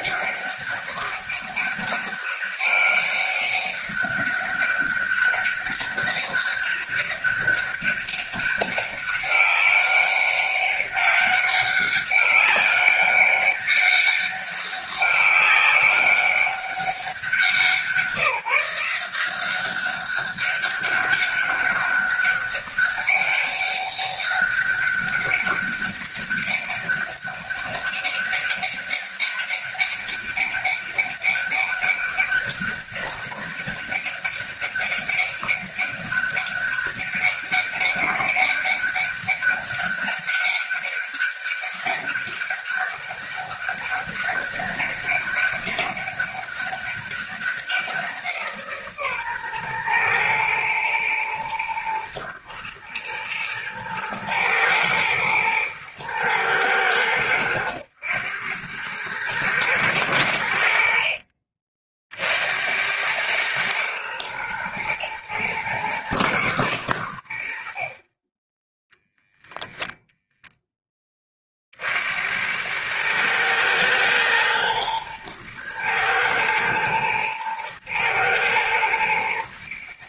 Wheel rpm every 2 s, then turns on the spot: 200, 200, 200, 200, 200, 200, 200, 200, 190, 170, 200, 200, 200, 200, 200, 200, 200, 200, 200, 200, 200, 200, 200, 200, 150, 110, 110, 110, 100, 100, 70, 90, 110, 100, 10, 10, 100, 110, 110, 120.
none